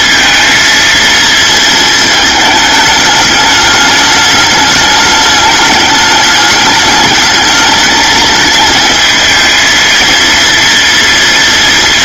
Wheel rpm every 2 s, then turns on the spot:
230, 210, 210, 210, 220, 230.
none